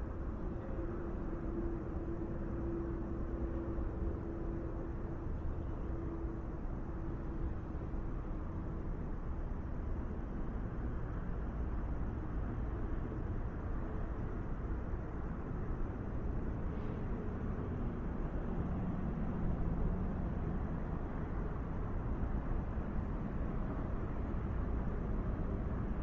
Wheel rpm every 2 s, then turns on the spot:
0, 0, 0, 0, 0, 0, 0, 0, 0, 0, 0, 0, 0.
none